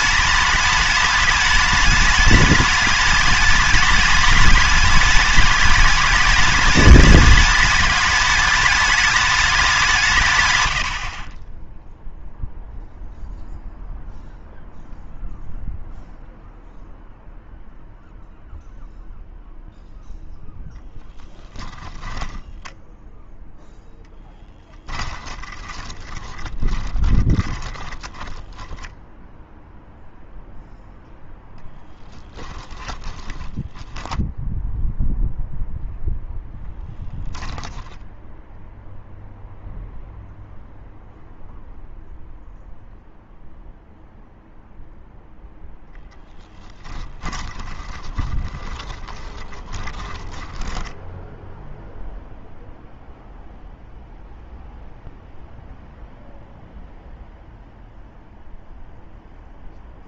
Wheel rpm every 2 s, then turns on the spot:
210, 210, 210, 210, 210, 100, 0, 0, 0, 0, 0, 10, 20, 20, 10, 0, 10, 0, 0, 0, 0, 0, 0, 10, 20, 10, 0, 0, 0, 0.
22-30 32-34 46-52